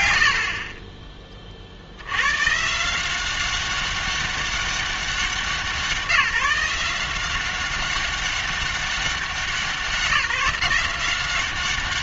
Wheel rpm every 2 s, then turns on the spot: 70, 150, 200, 180, 200, 180.
none